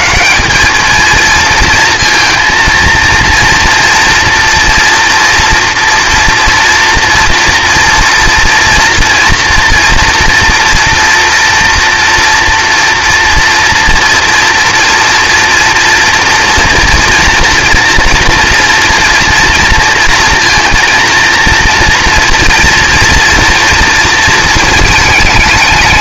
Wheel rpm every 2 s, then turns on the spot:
220, 230, 230, 230, 230, 230, 230, 230, 240, 230, 230, 240, 220.
none